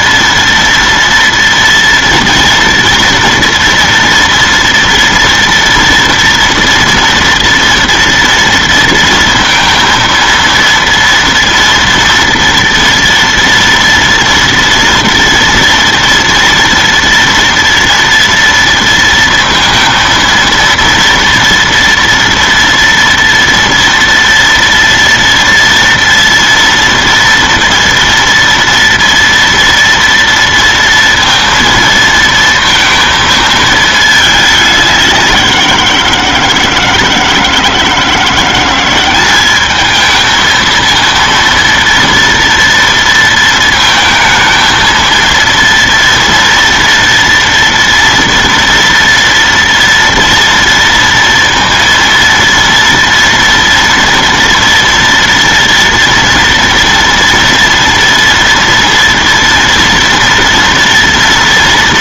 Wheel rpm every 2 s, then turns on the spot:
230, 230, 230, 230, 230, 230, 230, 230, 230, 230, 230, 230, 230, 230, 230, 230, 220, 190, 160, 190, 230, 230, 230, 230, 230, 230, 230, 230, 230, 230, 230.
none